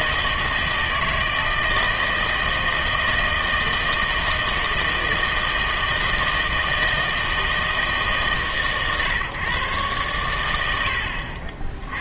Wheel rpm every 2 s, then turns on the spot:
160, 160, 160, 160, 140, 90.
none